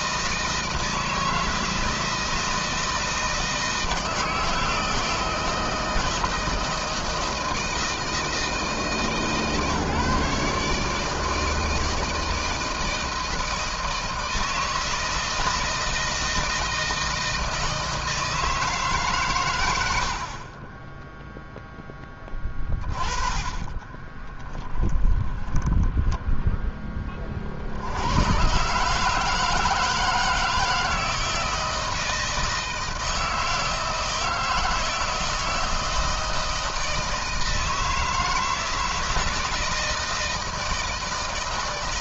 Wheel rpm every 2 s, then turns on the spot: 160, 160, 160, 160, 160, 150, 160, 160, 160, 140, 20, 20, 10, 10, 140, 170, 160, 160, 160, 160, 160.
22-26